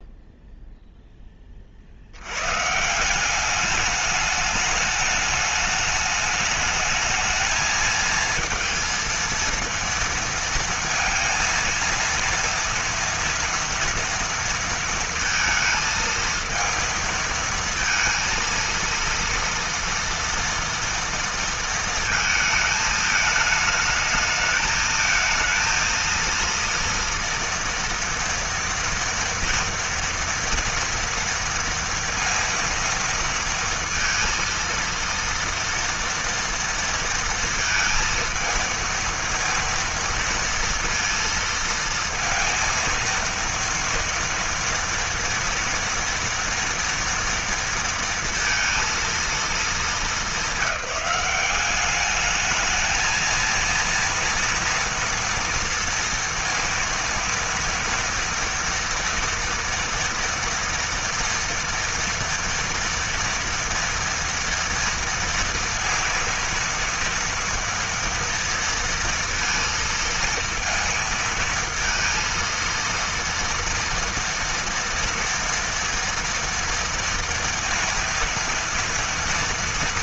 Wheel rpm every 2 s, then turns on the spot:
10, 180, 210, 220, 230, 230, 230, 230, 230, 230, 230, 220, 220, 230, 230, 230, 230, 230, 230, 230, 230, 230, 230, 230, 230, 190, 220, 230, 230, 230, 230, 230, 230, 230, 230, 230, 230, 230, 230, 230.
none